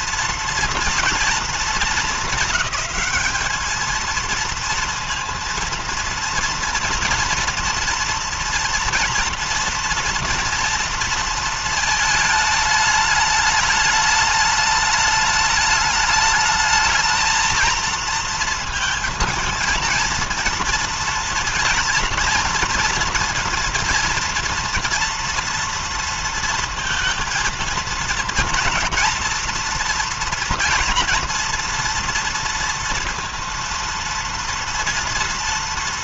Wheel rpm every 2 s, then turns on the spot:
230, 210, 230, 230, 230, 230, 220, 210, 220, 230, 230, 230, 230, 230, 230, 230, 230, 230.
none